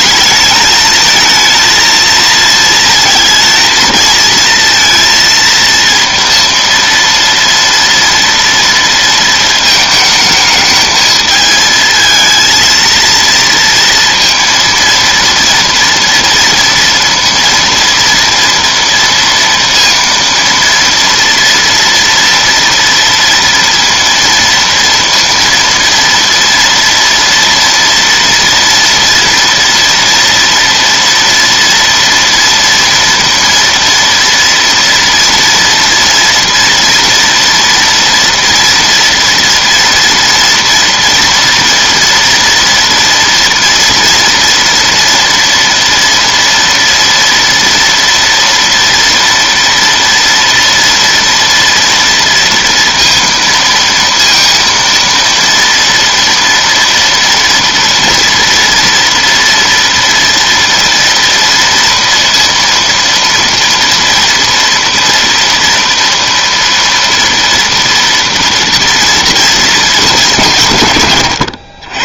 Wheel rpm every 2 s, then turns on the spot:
220, 230, 230, 230, 230, 220, 230, 230, 230, 230, 230, 230, 230, 230, 230, 240, 230, 230, 230, 240, 240, 230, 230, 230, 230, 230, 230, 230, 230, 230, 230, 230, 230, 230, 230, 150.
none